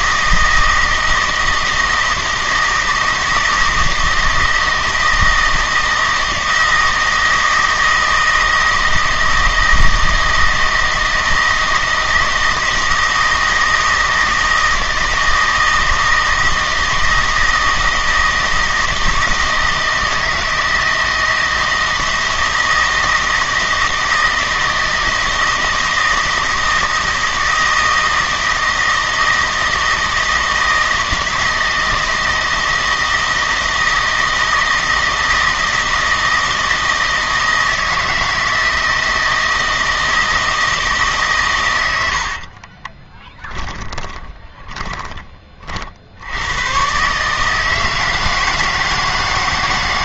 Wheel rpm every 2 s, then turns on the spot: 160, 160, 160, 160, 160, 160, 160, 160, 160, 160, 160, 160, 160, 160, 160, 160, 160, 160, 160, 160, 160, 20, 20, 120, 160.
42-46